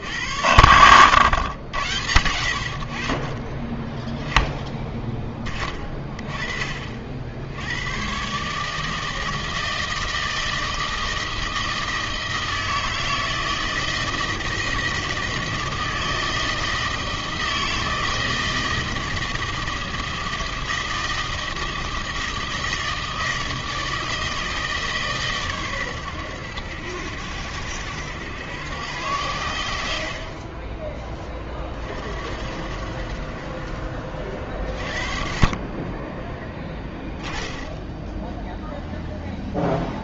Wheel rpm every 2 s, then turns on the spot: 70, 70, 10, 30, 140, 160, 160, 160, 160, 160, 160, 160, 160, 100, 100, 20, 60, 40, 10, 0.
none